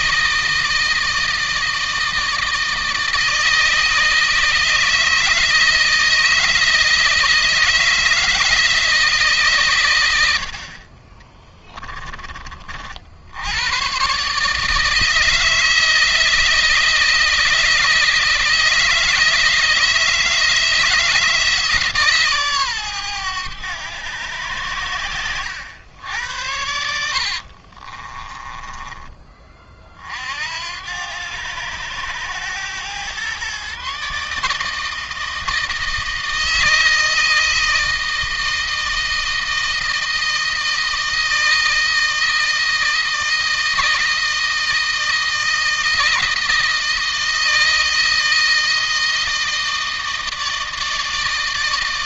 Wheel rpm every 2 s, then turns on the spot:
160, 160, 160, 160, 160, 50, 60, 160, 160, 160, 160, 120, 100, 80, 20, 80, 120, 160, 160, 160, 160, 160, 160, 160, 160, 160.
26-28